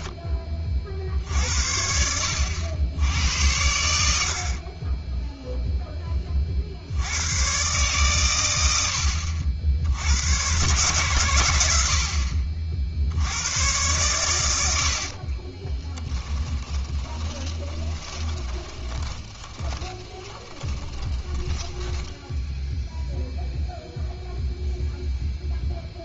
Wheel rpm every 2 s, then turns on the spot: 20, 90, 40, 50, 90, 120, 50, 100, 30, 20, 20, 10, 0.
4-6 16-22